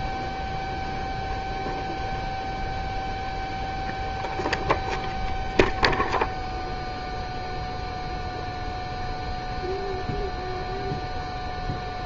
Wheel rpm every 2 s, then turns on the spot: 0, 0, 0, 0, 0, 0.
none